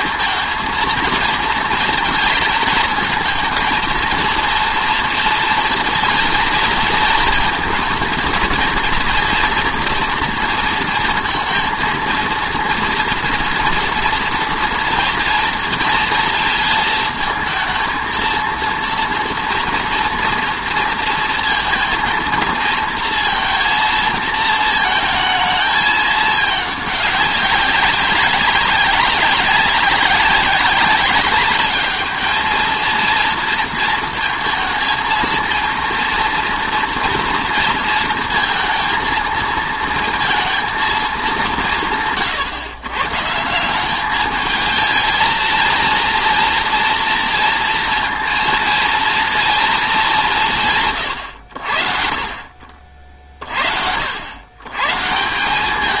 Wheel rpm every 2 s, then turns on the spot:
230, 230, 230, 230, 230, 230, 230, 230, 230, 230, 230, 230, 220, 210, 190, 190, 220, 230, 230, 230, 220, 120, 220, 230, 230, 160, 50, 110.
none